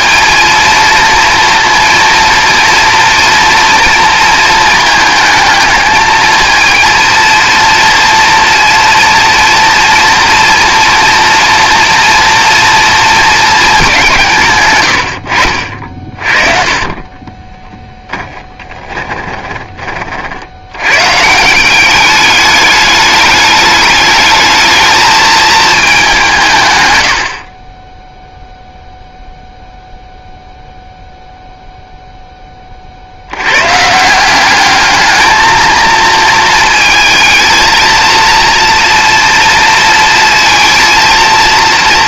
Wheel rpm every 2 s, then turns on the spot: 230, 230, 220, 230, 230, 230, 230, 110, 40, 10, 110, 210, 210, 120, 0, 0, 40, 210, 230, 230, 230.
16-20